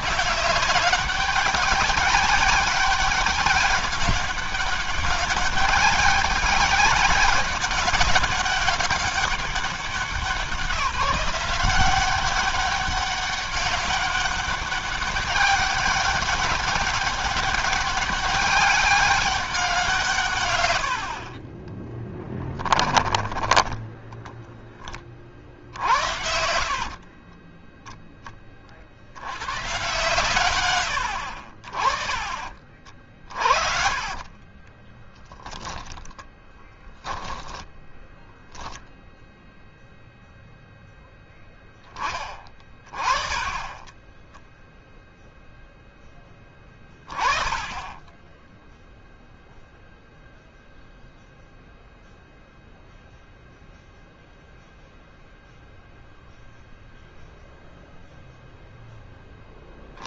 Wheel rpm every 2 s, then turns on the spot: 180, 200, 200, 200, 200, 180, 190, 200, 200, 200, 90, 10, 20, 60, 30, 110, 50, 30, 20, 0, 0, 30, 10, 10, 0, 0, 0, 0, 0, 0.
26-28 34-38